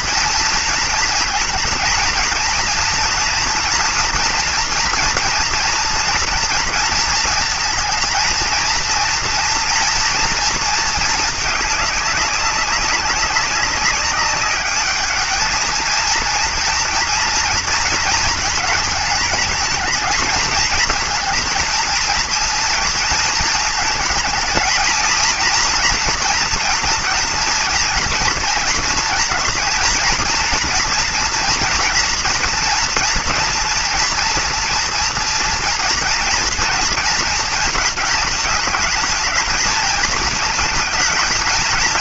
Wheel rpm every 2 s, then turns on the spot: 230, 230, 230, 230, 230, 230, 200, 200, 230, 220, 220, 230, 220, 230, 230, 230, 240, 240, 230, 220, 220.
none